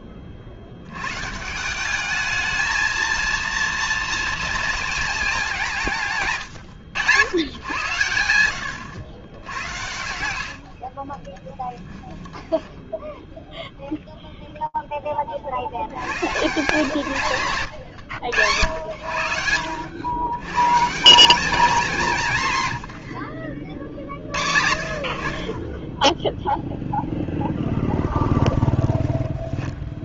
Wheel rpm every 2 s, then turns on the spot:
70, 220, 230, 100, 100, 60, 10, 0, 140, 100, 150, 130, 60, 0, 20.
10-14 28-30